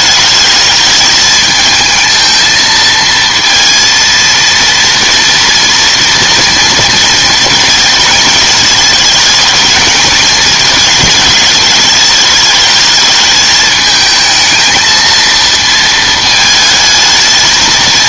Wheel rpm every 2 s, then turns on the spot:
220, 220, 230, 230, 220, 220, 210, 220, 220.
none